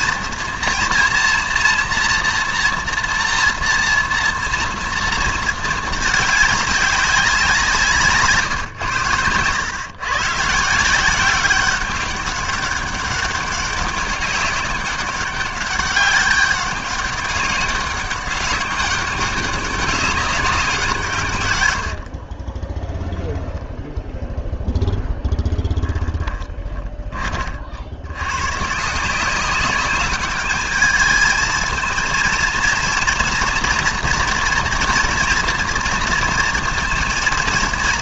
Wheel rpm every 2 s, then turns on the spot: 230, 230, 230, 200, 120, 170, 200, 190, 200, 200, 180, 0, 0, 20, 140, 210, 230, 230, 230.
26-28